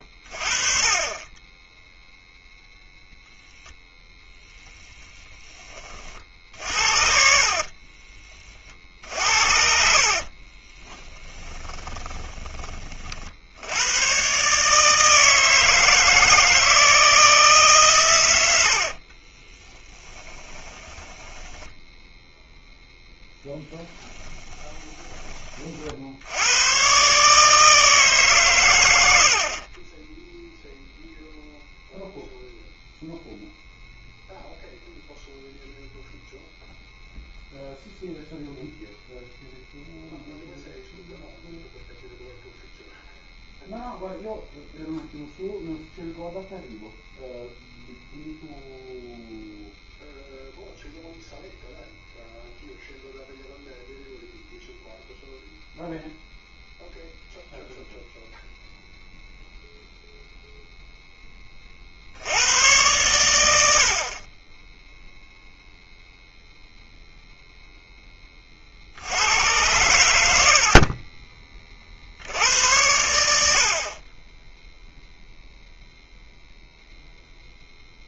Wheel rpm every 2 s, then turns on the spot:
30, 0, 10, 60, 50, 20, 40, 150, 160, 60, 10, 0, 10, 120, 100, 0, 0, 0, 0, 0, 0, 0, 0, 0, 0, 0, 0, 0, 0, 0, 0, 100, 0, 0, 60, 50, 90, 0, 0.
4-8 10-12 18-22 24-26